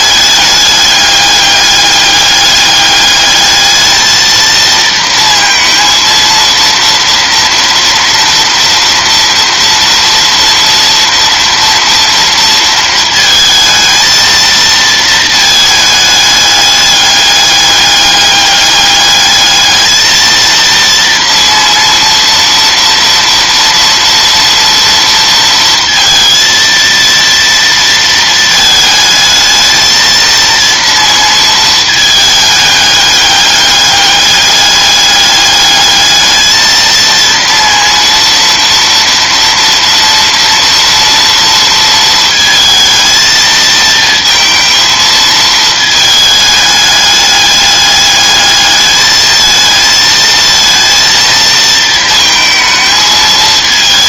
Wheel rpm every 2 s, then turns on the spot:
210, 210, 230, 230, 230, 230, 230, 230, 210, 200, 230, 240, 230, 230, 220, 230, 210, 200, 220, 230, 230, 230, 230, 210, 210, 230, 220.
none